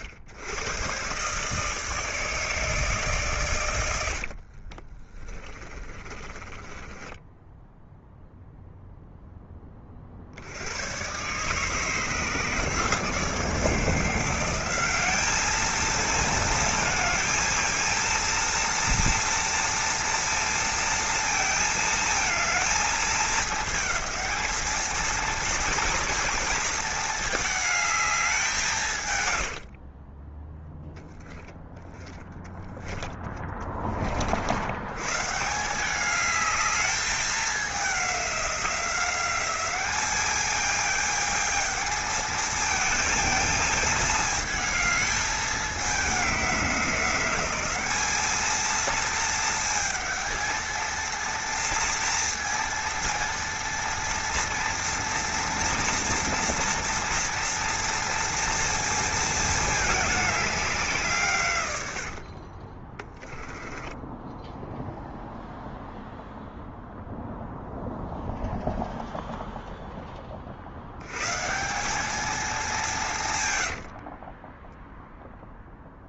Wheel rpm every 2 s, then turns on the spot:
120, 150, 40, 20, 0, 90, 150, 180, 220, 230, 230, 220, 220, 220, 160, 0, 10, 80, 210, 190, 210, 220, 220, 190, 220, 230, 230, 230, 230, 230, 190, 30, 0, 0, 0, 70, 190, 10.
6-8 32-34 62-64 74-76